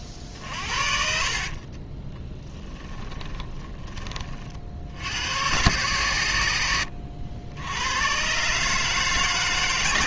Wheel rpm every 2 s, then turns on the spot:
50, 20, 60, 90, 150.
0-4